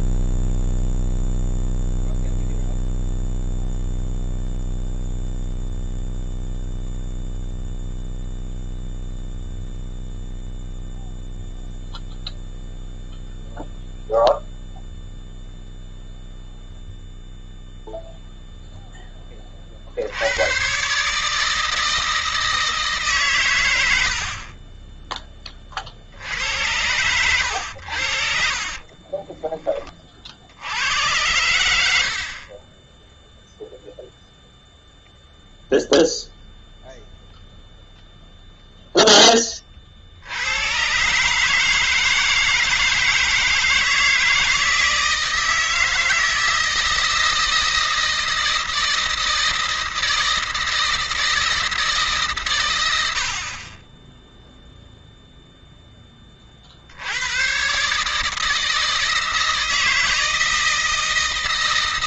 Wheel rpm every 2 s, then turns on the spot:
0, 0, 0, 0, 0, 0, 0, 0, 0, 0, 100, 160, 30, 80, 50, 70, 40, 0, 0, 0, 90, 160, 160, 160, 160, 160, 130, 10, 40, 150, 160.
24-26 28-30